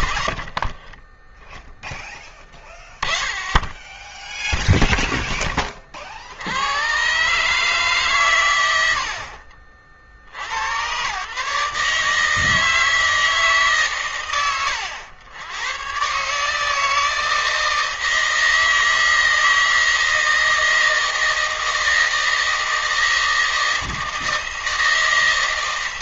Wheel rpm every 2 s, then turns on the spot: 50, 20, 0, 90, 120, 80, 160, 120, 140, 160, 160, 160, 160.
0-2